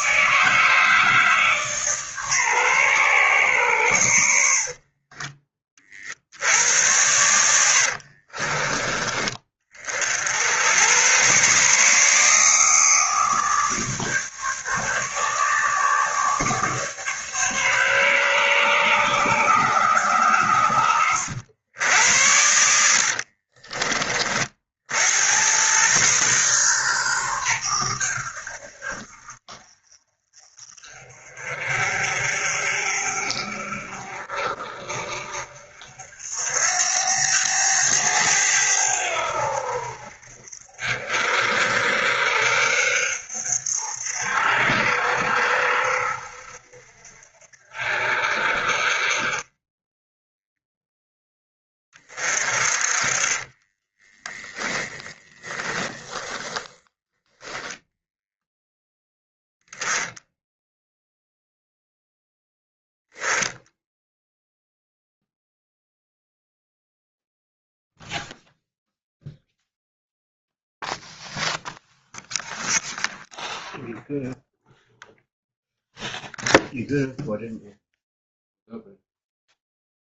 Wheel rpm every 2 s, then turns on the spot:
160, 130, 50, 90, 30, 100, 150, 150, 150, 140, 100, 80, 60, 120, 70, 40, 50, 50, 80, 90, 50, 60, 70, 60, 40, 0, 40, 10, 30, 10, 0, 0, 0, 0, 0, 0, 0, 0, 0, 0.
4-6 20-24 52-58